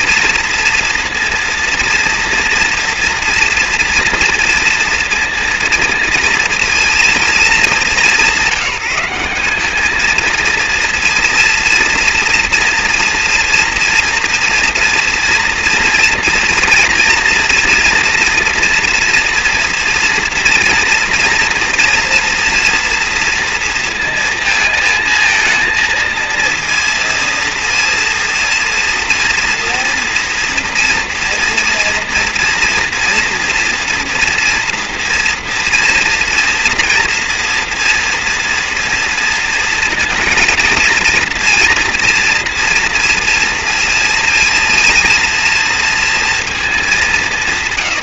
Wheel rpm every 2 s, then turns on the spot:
230, 230, 230, 220, 190, 230, 230, 230, 230, 230, 240, 240, 230, 230, 230, 230, 230, 240, 230, 240, 230, 230, 230, 210.
none